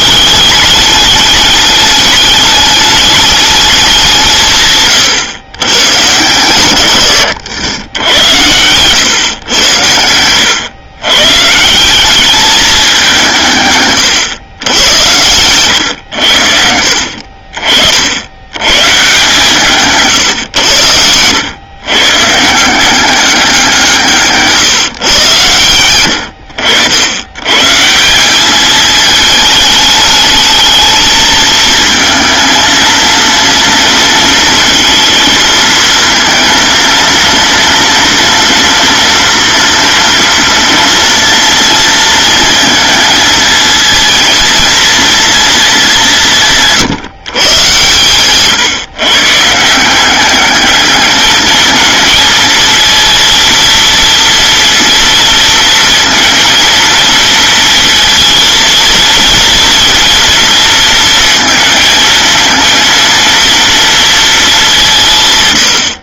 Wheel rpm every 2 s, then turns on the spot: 200, 210, 120, 110, 120, 140, 180, 100, 50, 140, 100, 190, 130, 100, 210, 220, 230, 230, 230, 240, 230, 220, 230, 150, 130, 220, 230, 230, 230, 230, 230, 230, 160.
none